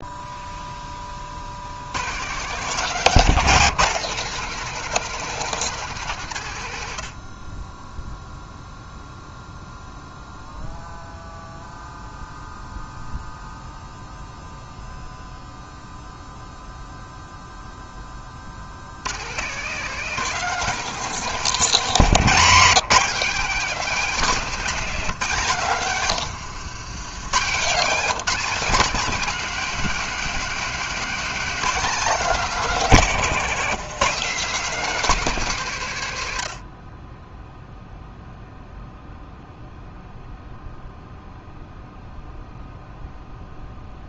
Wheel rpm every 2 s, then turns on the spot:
0, 140, 170, 110, 0, 0, 0, 0, 0, 50, 160, 190, 220, 110, 230, 240, 230, 210, 100, 0, 0, 0.
26-28